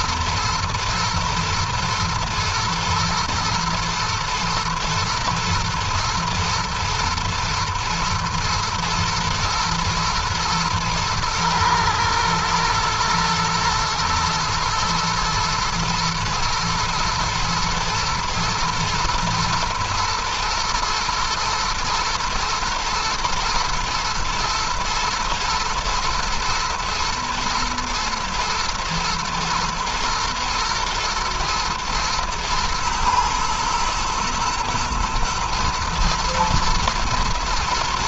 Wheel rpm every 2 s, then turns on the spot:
120, 120, 120, 110, 110, 120, 120, 110, 110, 110, 120, 120, 110, 120, 120, 110, 120, 120, 120.
none